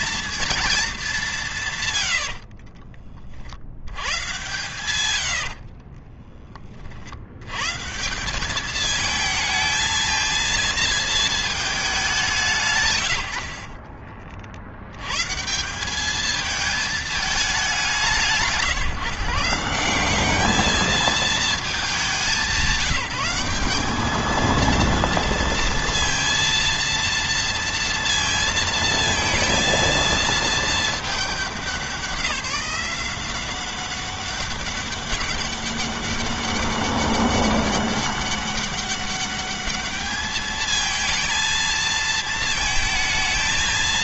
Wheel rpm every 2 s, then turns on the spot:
220, 40, 110, 30, 200, 230, 170, 70, 220, 150, 210, 200, 220, 230, 230, 220, 180, 200, 200, 200, 220, 220.
2-4